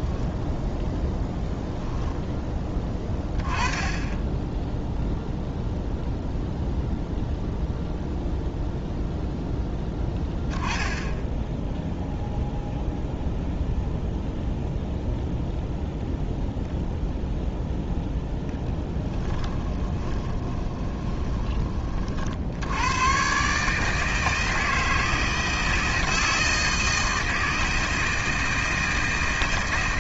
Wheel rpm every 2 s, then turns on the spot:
0, 20, 0, 0, 0, 10, 0, 0, 0, 10, 20, 110, 160, 160, 160.
18-22